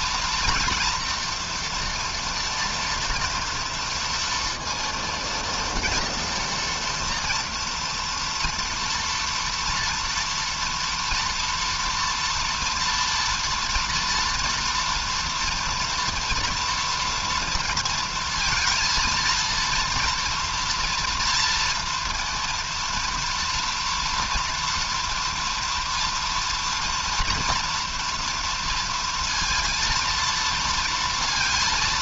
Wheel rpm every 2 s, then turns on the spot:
230, 230, 230, 230, 230, 230, 240, 230, 230, 230, 230, 230, 230, 230, 230, 230.
none